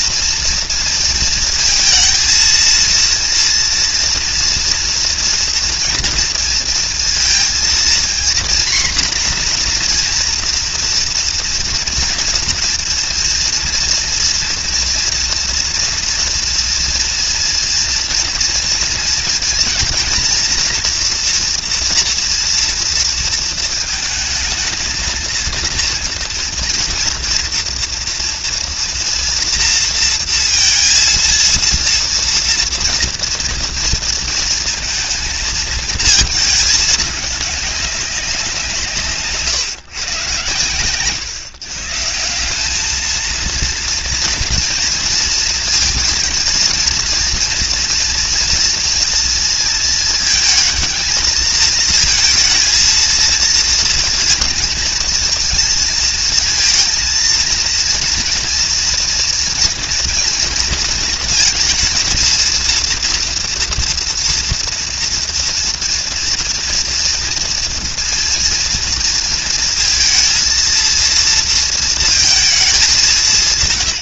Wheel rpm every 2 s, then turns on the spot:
230, 230, 230, 230, 250, 240, 230, 230, 230, 230, 230, 230, 220, 230, 230, 230, 240, 230, 210, 160, 130, 210, 230, 230, 230, 220, 230, 230, 230, 230, 230, 230, 230, 230, 230, 230, 200.
none